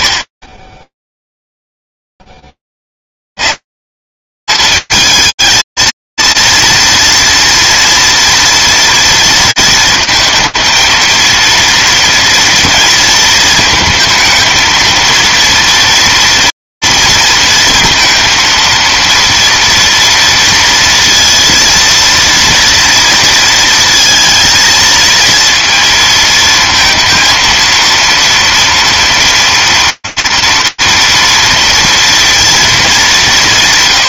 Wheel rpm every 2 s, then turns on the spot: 30, 0, 170, 230, 230, 220, 230, 230, 240, 230, 230, 230, 230, 220, 230, 230, 230.
none